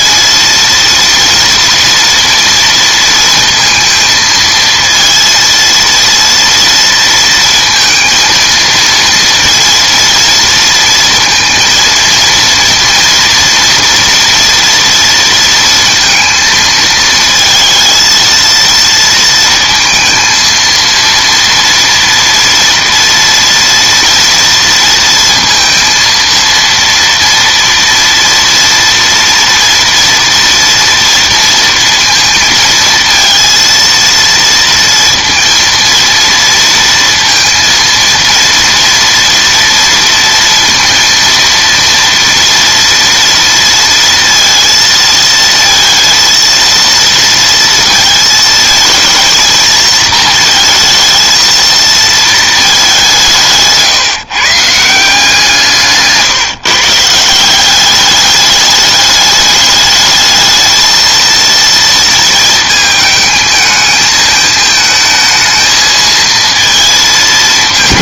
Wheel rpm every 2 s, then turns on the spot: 230, 230, 230, 230, 230, 230, 230, 230, 220, 230, 230, 230, 230, 230, 230, 230, 230, 230, 230, 230, 230, 230, 230, 230, 220, 220, 210, 160, 150, 210, 220, 220, 220, 230.
none